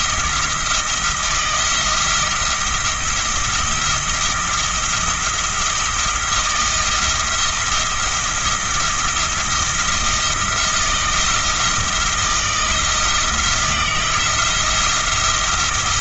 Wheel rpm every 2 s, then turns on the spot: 160, 170, 170, 170, 170, 170, 160, 170.
none